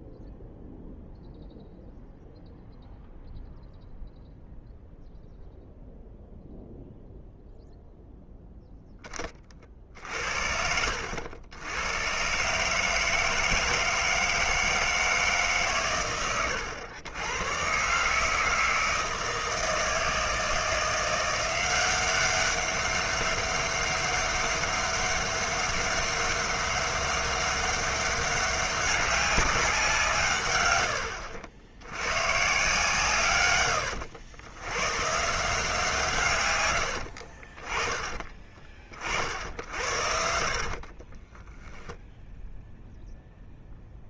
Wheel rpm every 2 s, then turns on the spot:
0, 0, 0, 0, 0, 70, 140, 160, 100, 160, 160, 200, 200, 200, 200, 110, 140, 100, 110, 30, 60, 0.
40-42